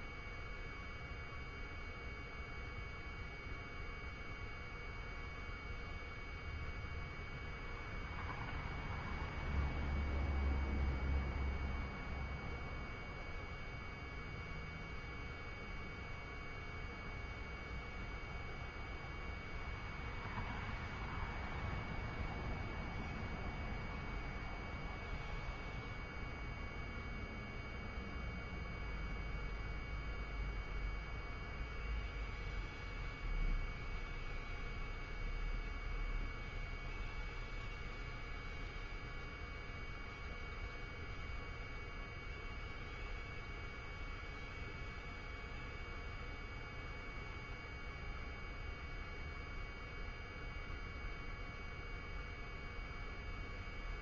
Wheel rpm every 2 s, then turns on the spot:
0, 0, 0, 0, 0, 0, 0, 0, 0, 0, 0, 0, 0, 0, 0, 0, 0, 0, 0, 0, 0, 0, 0, 0, 0, 0, 0.
none